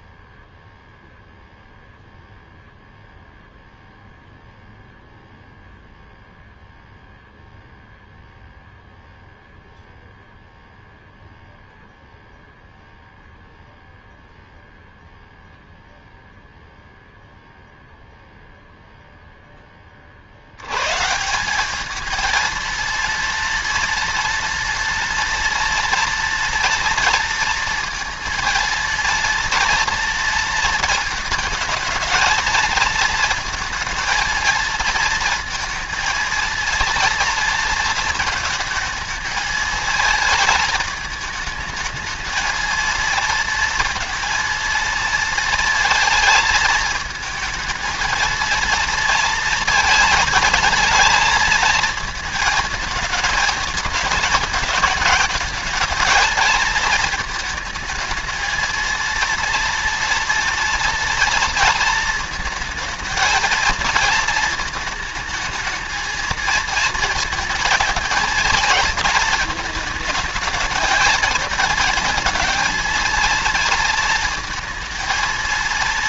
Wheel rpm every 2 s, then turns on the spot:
0, 0, 0, 0, 0, 0, 0, 0, 0, 0, 100, 230, 230, 230, 230, 230, 220, 230, 230, 220, 220, 230, 230, 220, 230, 220, 220, 220, 220, 230, 230, 220, 220, 230, 230, 220, 220, 230.
none